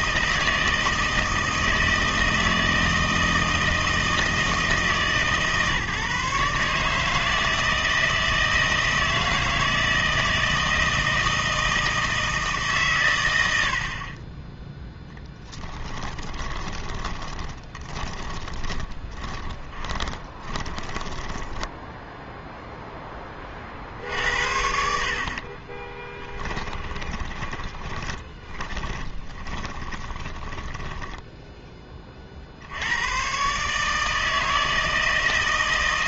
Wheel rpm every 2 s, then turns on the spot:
160, 160, 160, 150, 160, 160, 140, 10, 20, 20, 20, 0, 60, 20, 20, 10, 80, 160.
16-22 26-32